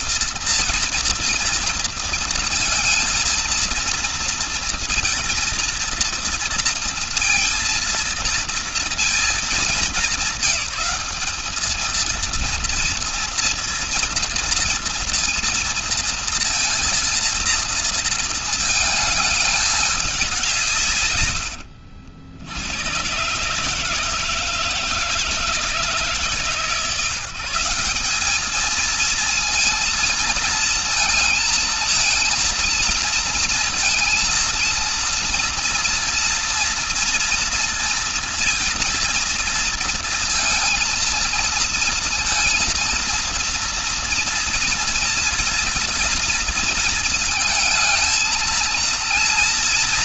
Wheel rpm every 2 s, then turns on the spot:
230, 230, 230, 230, 220, 220, 230, 230, 230, 210, 90, 140, 160, 170, 220, 220, 230, 230, 230, 230, 230, 230, 230, 230, 230.
none